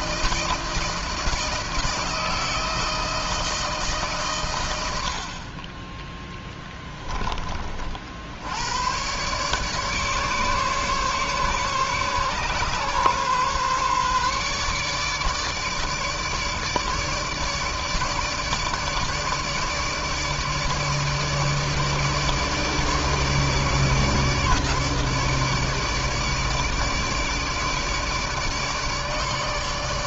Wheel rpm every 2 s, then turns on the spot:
160, 160, 110, 10, 90, 140, 130, 150, 150, 150, 150, 150, 150, 150, 150.
6-8